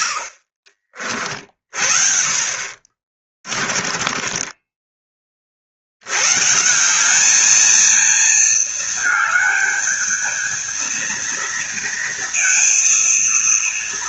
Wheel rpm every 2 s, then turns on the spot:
70, 40, 20, 180, 220, 230, 230.
none